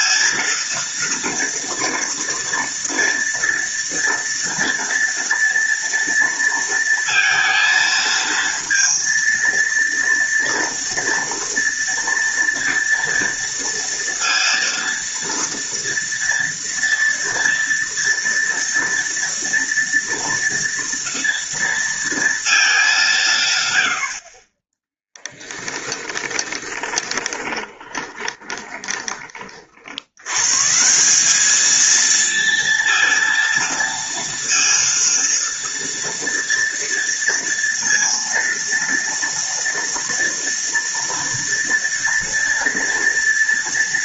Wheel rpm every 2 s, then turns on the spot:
230, 230, 230, 230, 230, 230, 230, 230, 230, 230, 230, 200, 10, 20, 20, 160, 230, 230, 230, 230, 230, 230.
24-30